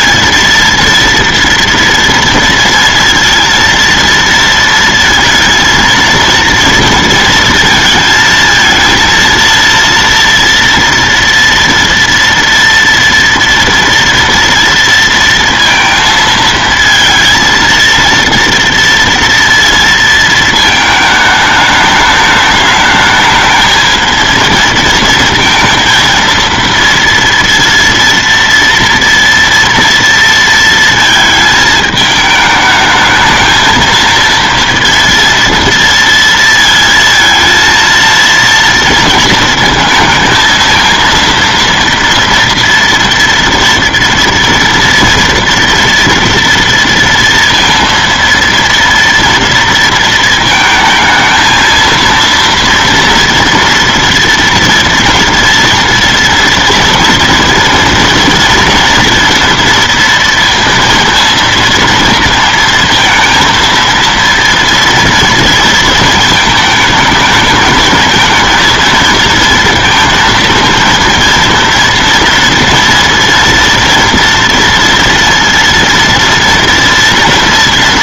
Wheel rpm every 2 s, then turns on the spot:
230, 230, 230, 230, 220, 240, 230, 230, 220, 230, 220, 210, 230, 230, 230, 230, 210, 230, 230, 230, 230, 230, 230, 230, 230, 220, 230, 230, 230, 230, 230, 230, 230, 220, 230, 230, 230, 230, 240.
none